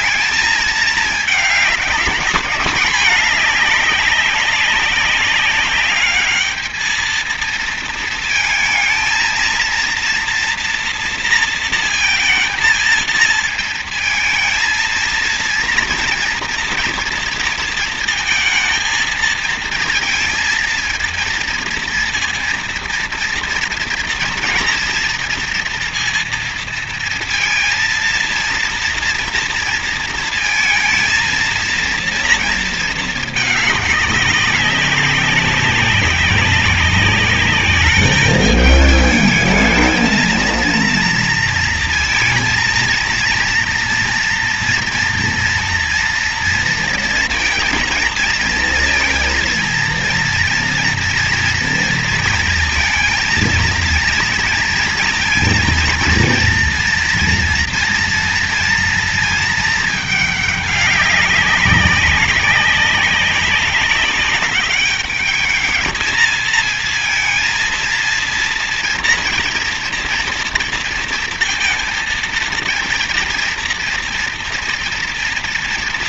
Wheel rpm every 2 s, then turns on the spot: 220, 210, 200, 220, 230, 230, 230, 230, 230, 220, 220, 230, 230, 230, 230, 230, 220, 200, 200, 210, 230, 230, 240, 230, 230, 240, 230, 230, 230, 230, 200, 190, 200, 220, 230, 230, 230, 230.
none